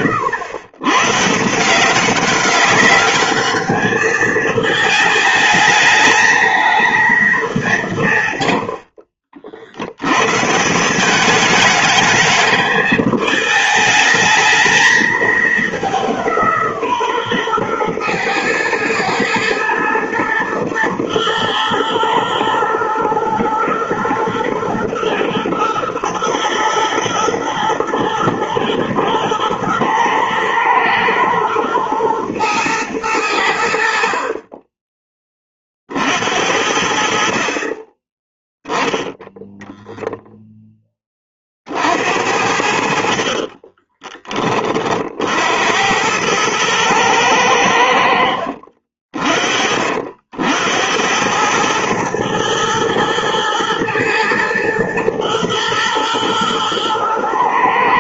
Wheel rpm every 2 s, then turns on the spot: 120, 200, 220, 220, 80, 170, 220, 220, 150, 120, 120, 120, 110, 110, 110, 110, 110, 20, 60, 10, 10, 60, 40, 110, 50, 80, 110, 120, 110.
8-10